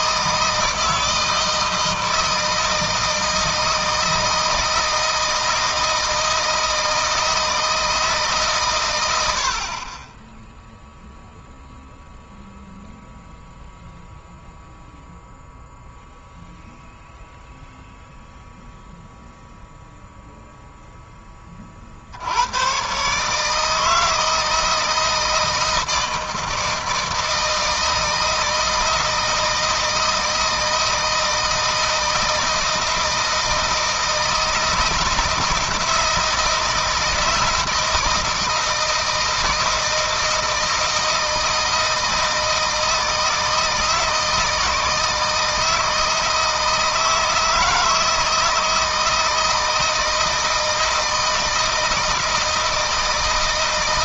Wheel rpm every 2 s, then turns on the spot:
160, 160, 160, 160, 100, 0, 0, 0, 0, 0, 20, 150, 160, 160, 160, 160, 160, 160, 160, 160, 160, 160, 160, 160, 160, 160, 160.
none